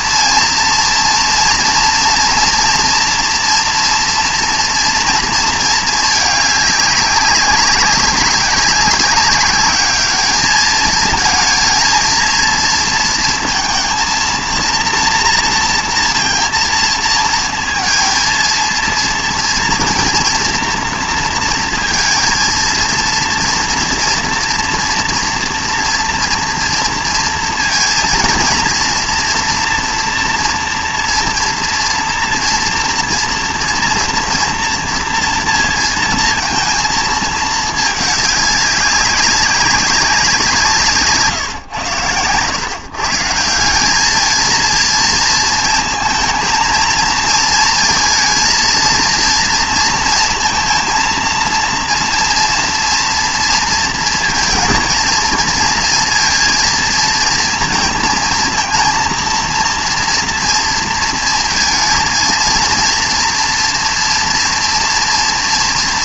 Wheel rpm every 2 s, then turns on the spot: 230, 230, 230, 200, 200, 220, 230, 230, 230, 230, 230, 230, 240, 230, 230, 240, 230, 240, 230, 200, 170, 140, 230, 230, 230, 230, 230, 230, 230, 230, 230, 230, 230.
none